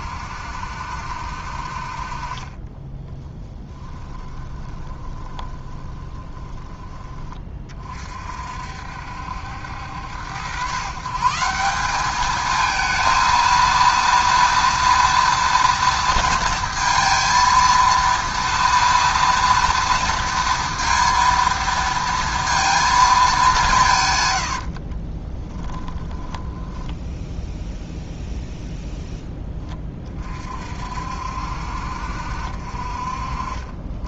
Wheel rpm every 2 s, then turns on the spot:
60, 10, 20, 20, 60, 120, 220, 230, 230, 230, 230, 230, 60, 10, 0, 50, 50.
2-8 24-28